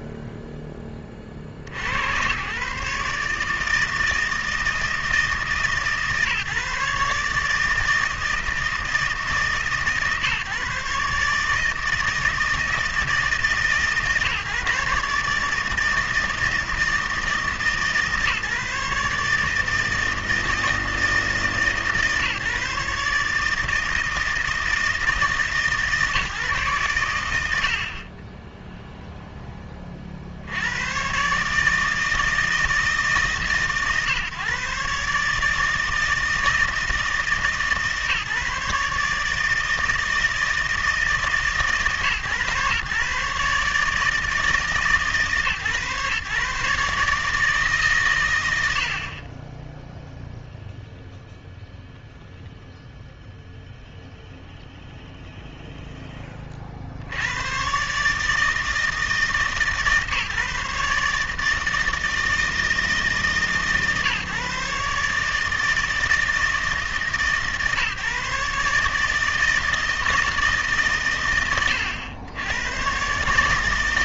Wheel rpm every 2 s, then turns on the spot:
10, 120, 160, 140, 160, 140, 160, 150, 160, 150, 160, 150, 160, 140, 10, 100, 160, 130, 160, 150, 160, 130, 150, 140, 90, 0, 0, 0, 40, 160, 140, 160, 140, 150, 150, 140, 110.
none